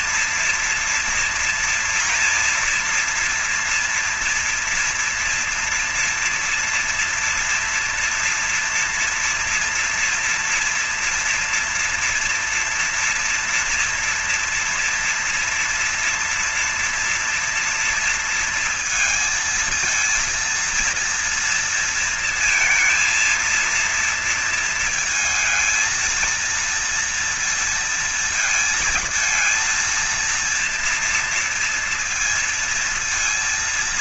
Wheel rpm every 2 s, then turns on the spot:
230, 230, 240, 230, 230, 230, 240, 240, 230, 230, 230, 230, 230, 230, 230, 230, 230.
none